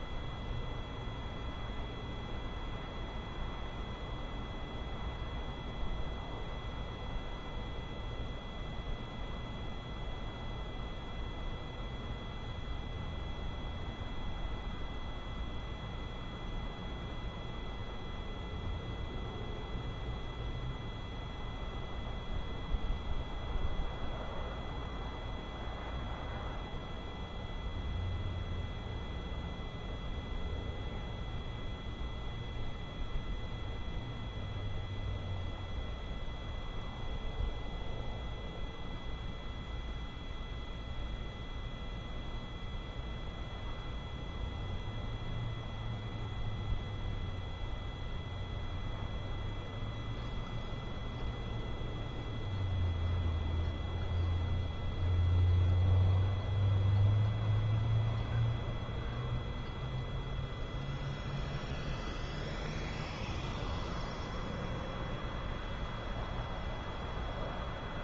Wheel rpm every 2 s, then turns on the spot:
0, 0, 0, 0, 0, 0, 0, 0, 0, 0, 0, 0, 0, 0, 0, 0, 0, 0, 0, 0, 0, 0, 0, 0, 0, 0, 0, 0, 0, 0, 0, 0, 0, 0.
none